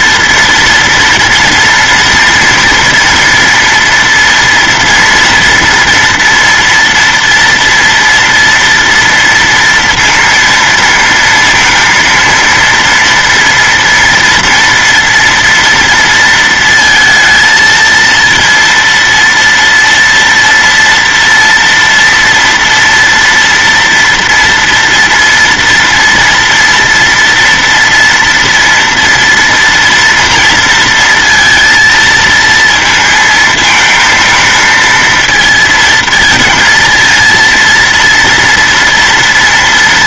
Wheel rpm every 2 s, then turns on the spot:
230, 240, 230, 230, 230, 230, 230, 230, 230, 230, 230, 230, 230, 230, 230, 230, 220, 230, 230, 230.
none